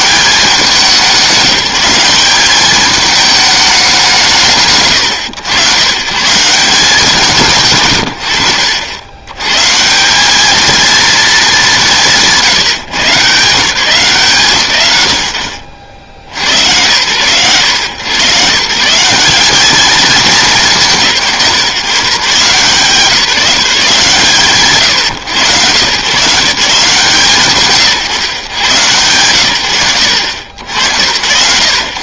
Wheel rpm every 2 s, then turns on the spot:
200, 200, 150, 170, 80, 220, 160, 120, 110, 150, 160, 160, 160, 150, 110, 60.
none